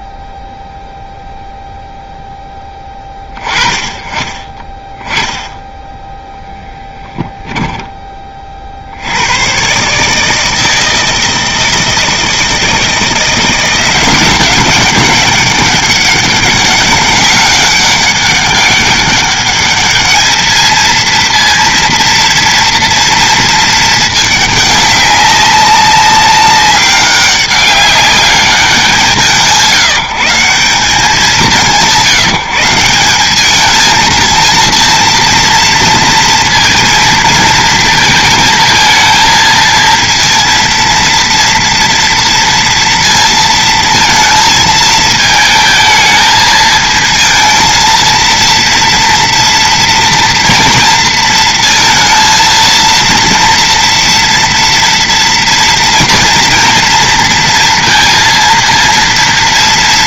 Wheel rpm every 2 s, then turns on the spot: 0, 10, 20, 10, 60, 160, 160, 190, 200, 200, 220, 230, 200, 200, 190, 180, 170, 230, 230, 220, 230, 230, 220, 220, 230, 230, 230, 240, 230, 230.
none